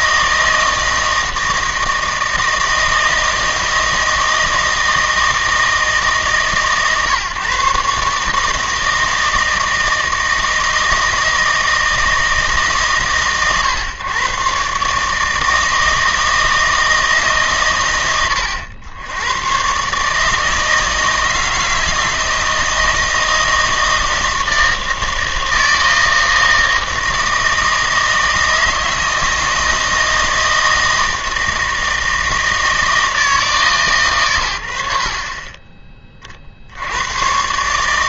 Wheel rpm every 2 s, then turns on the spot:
160, 160, 160, 140, 160, 160, 150, 140, 160, 80, 160, 160, 160, 160, 160, 160, 160, 80, 60.
none